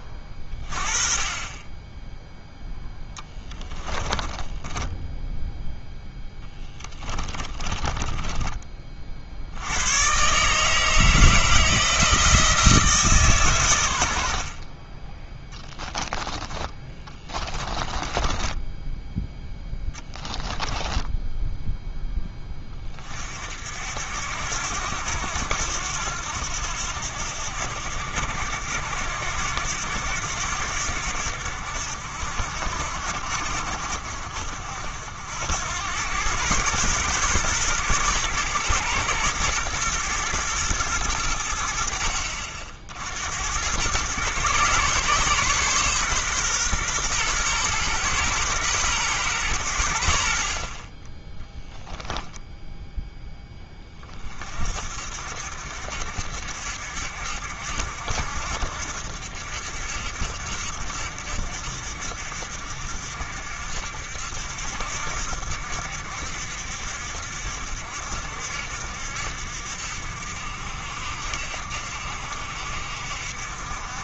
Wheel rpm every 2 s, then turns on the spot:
30, 0, 20, 20, 30, 150, 160, 40, 20, 10, 10, 20, 90, 80, 80, 80, 60, 60, 120, 120, 110, 70, 130, 120, 120, 40, 10, 50, 60, 70, 60, 60, 70, 60, 60, 60, 60.
4-8 14-22